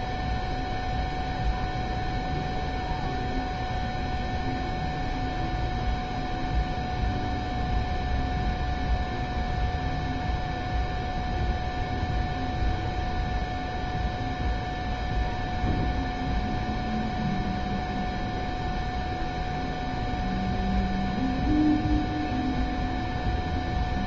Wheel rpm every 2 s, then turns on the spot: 0, 0, 0, 0, 0, 0, 0, 0, 0, 0, 0, 0.
none